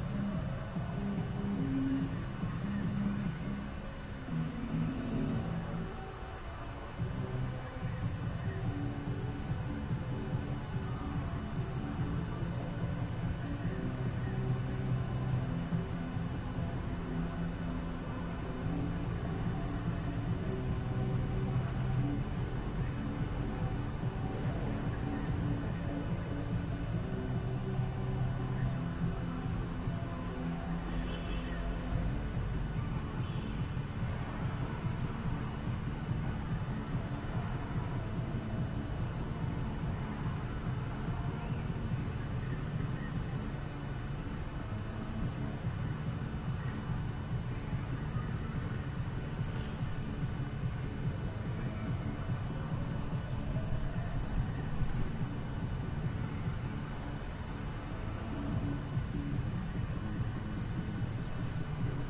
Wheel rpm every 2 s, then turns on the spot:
0, 0, 0, 0, 0, 0, 0, 0, 0, 0, 0, 0, 0, 0, 0, 0, 0, 0, 0, 0, 0, 0, 0, 0, 0, 0, 0, 0, 0, 0, 0.
none